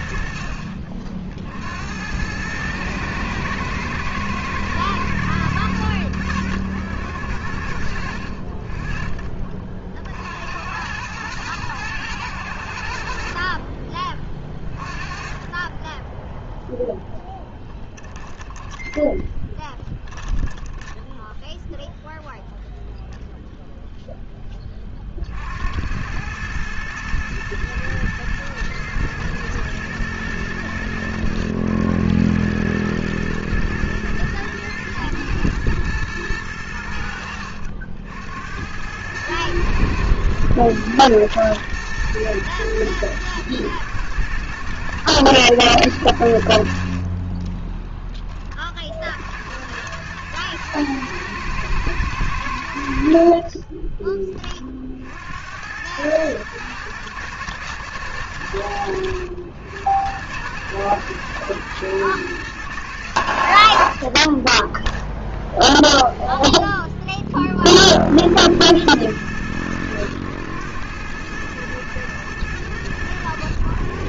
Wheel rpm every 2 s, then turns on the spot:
60, 110, 90, 70, 40, 110, 40, 30, 10, 10, 10, 0, 60, 110, 110, 90, 110, 110, 70, 110, 110, 110, 110, 40, 60, 110, 60, 60, 110, 90, 110, 120, 20, 0, 90, 100, 110.
18-20 46-48